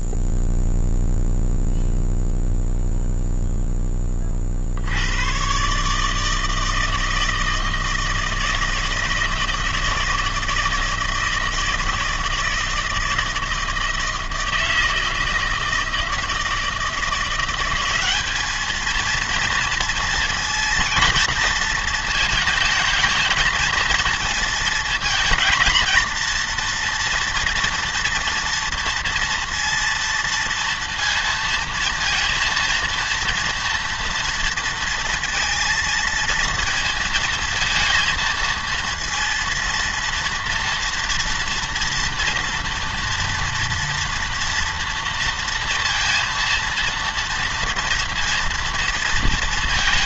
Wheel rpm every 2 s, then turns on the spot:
0, 0, 0, 130, 160, 160, 160, 160, 160, 190, 230, 230, 230, 230, 230, 230, 230, 230, 230, 230, 230, 230, 230, 230, 230.
none